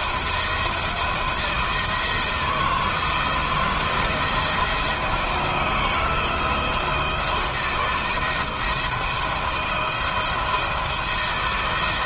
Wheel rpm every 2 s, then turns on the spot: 160, 160, 170, 170, 170, 170.
none